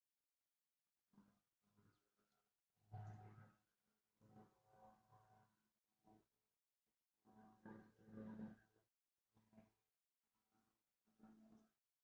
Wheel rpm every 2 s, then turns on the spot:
0, 0, 0, 0, 0, 0.
none